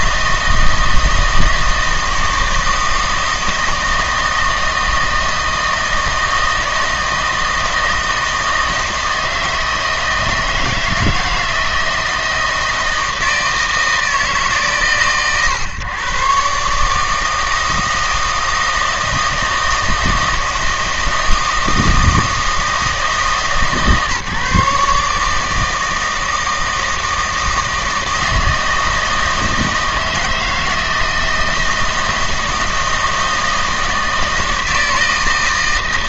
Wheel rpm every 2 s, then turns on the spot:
160, 160, 160, 160, 160, 160, 160, 130, 140, 160, 160, 160, 150, 160, 160, 160, 160, 160.
none